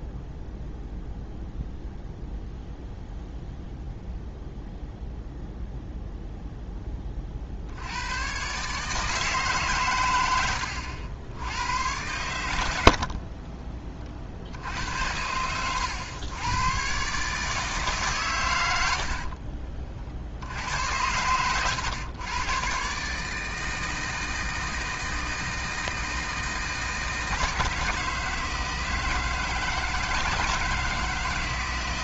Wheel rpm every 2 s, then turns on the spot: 0, 0, 0, 0, 140, 100, 100, 60, 110, 110, 70, 120, 160, 160, 160, 160.
10-12